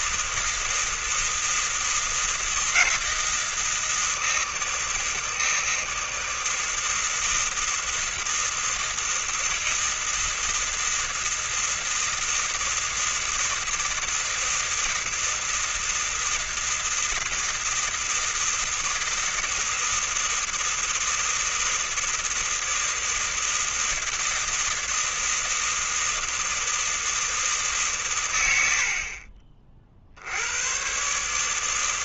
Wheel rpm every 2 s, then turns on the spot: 160, 160, 160, 160, 160, 160, 160, 160, 160, 160, 160, 160, 160, 160, 70, 120.
none